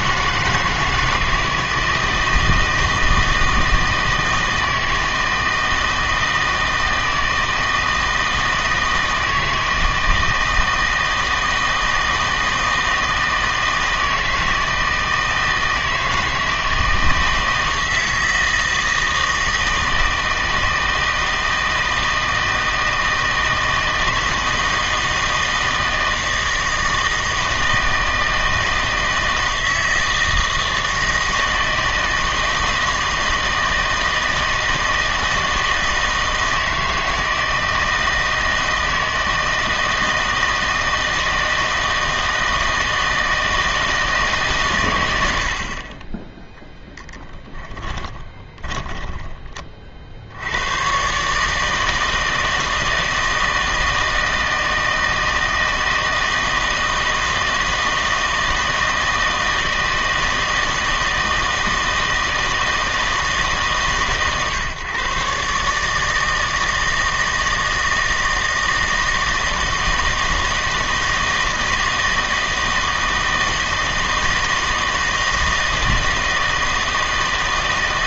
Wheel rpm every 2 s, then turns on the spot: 160, 160, 160, 160, 160, 160, 160, 160, 160, 160, 160, 160, 160, 160, 160, 160, 160, 160, 160, 160, 160, 160, 130, 10, 20, 100, 160, 160, 160, 160, 160, 160, 130, 160, 160, 160, 160, 160, 160.
48-50